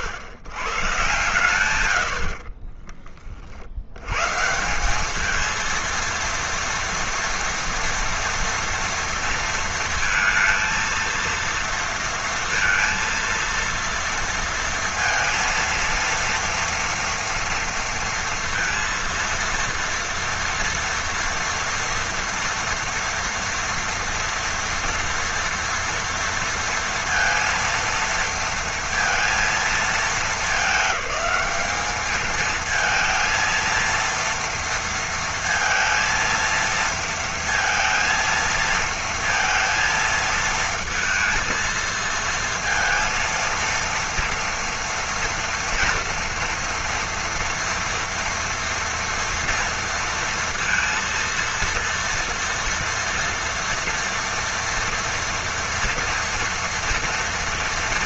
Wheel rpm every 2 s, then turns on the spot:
110, 40, 180, 230, 230, 230, 230, 230, 230, 230, 230, 240, 230, 230, 230, 210, 220, 230, 230, 230, 230, 230, 230, 230, 230, 230, 230, 230, 230.
2-4